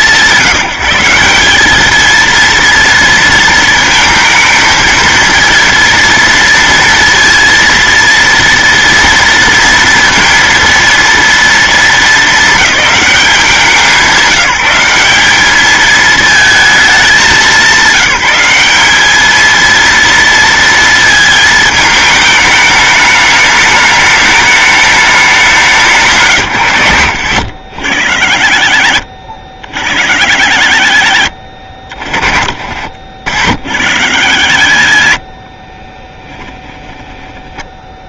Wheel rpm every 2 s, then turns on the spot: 170, 230, 230, 230, 230, 230, 200, 190, 210, 200, 230, 210, 200, 100, 60, 70, 30, 60, 10.
32-34